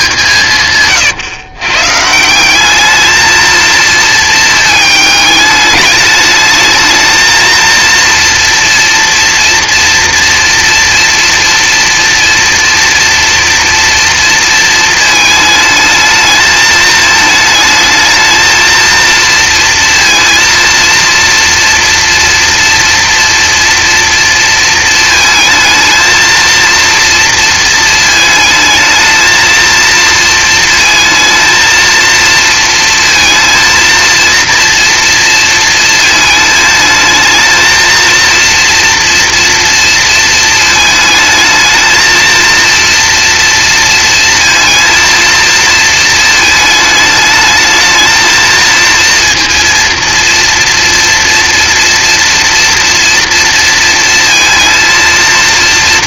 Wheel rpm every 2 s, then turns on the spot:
140, 200, 220, 220, 230, 230, 240, 220, 220, 220, 230, 230, 230, 230, 220, 220, 230, 230, 220, 230, 220, 230, 220, 220, 230, 230, 230, 230.
none